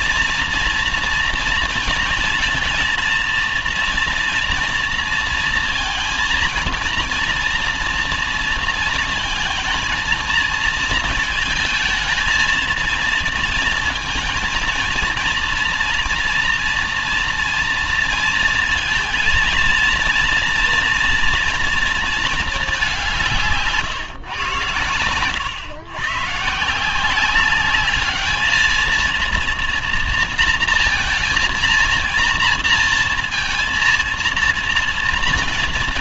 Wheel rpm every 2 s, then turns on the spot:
230, 230, 230, 230, 230, 230, 220, 230, 230, 230, 230, 210, 110, 140, 220, 230, 230, 230.
none